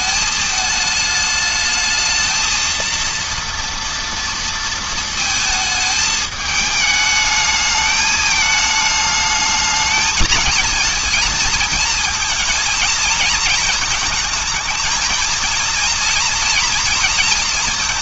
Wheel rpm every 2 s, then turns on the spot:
220, 220, 230, 210, 210, 220, 220, 220, 230.
none